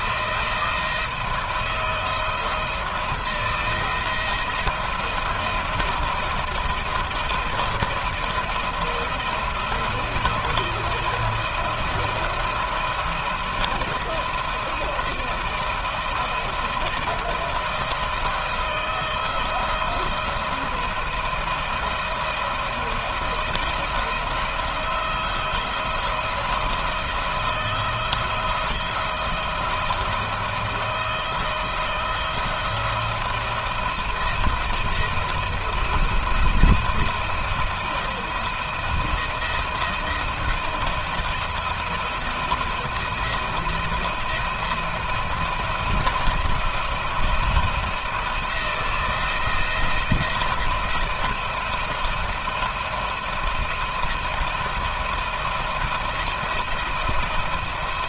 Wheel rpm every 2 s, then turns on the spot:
170, 170, 170, 170, 170, 170, 170, 170, 170, 160, 170, 160, 170, 170, 160, 170, 160, 170, 170, 170, 170, 170, 170, 170, 170, 170, 170, 170, 170.
none